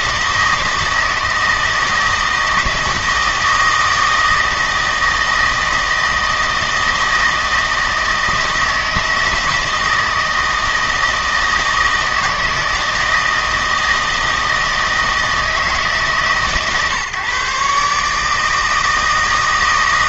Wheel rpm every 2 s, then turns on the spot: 160, 160, 160, 160, 160, 160, 160, 160, 130, 160.
none